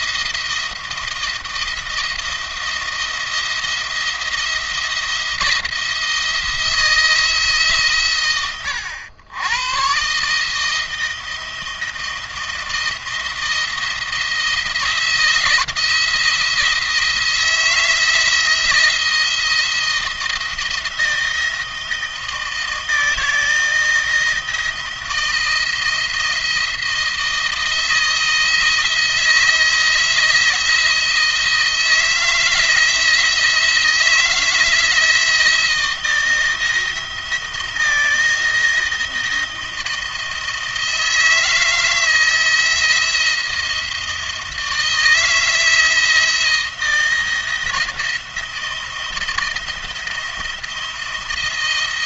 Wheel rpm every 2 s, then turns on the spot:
170, 170, 170, 160, 110, 160, 170, 170, 170, 170, 170, 160, 170, 170, 170, 170, 160, 160, 170, 160, 160, 160, 170, 160, 160, 170.
none